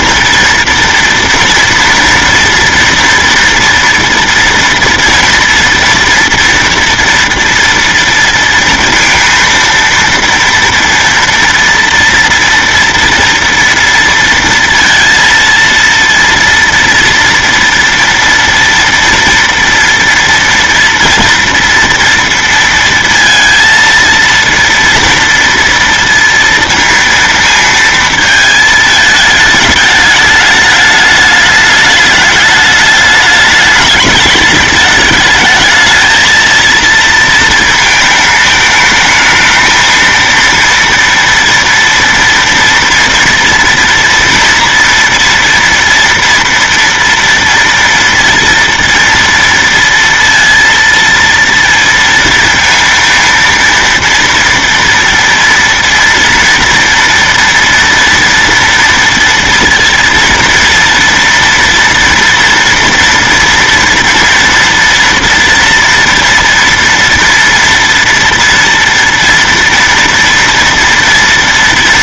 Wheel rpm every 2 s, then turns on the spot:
230, 230, 230, 230, 230, 230, 230, 230, 230, 230, 230, 230, 230, 230, 220, 210, 210, 210, 220, 220, 230, 230, 230, 230, 230, 230, 230, 230, 230, 230, 230, 230, 230, 230, 230, 230.
none